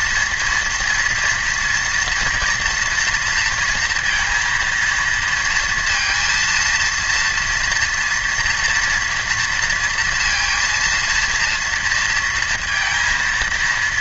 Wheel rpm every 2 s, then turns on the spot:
240, 230, 230, 230, 230, 230, 230.
none